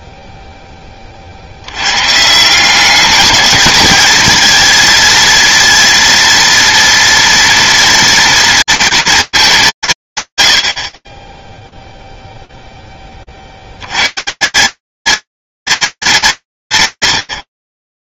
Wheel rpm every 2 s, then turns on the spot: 20, 190, 230, 240, 240, 140, 0, 160, 160.
none